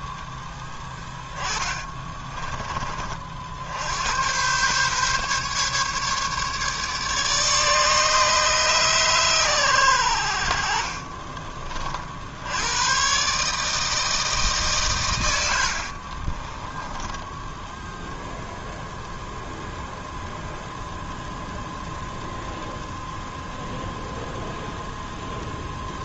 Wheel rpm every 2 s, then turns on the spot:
10, 40, 140, 150, 130, 40, 120, 120, 20, 0, 0, 0, 0.
0-2 16-18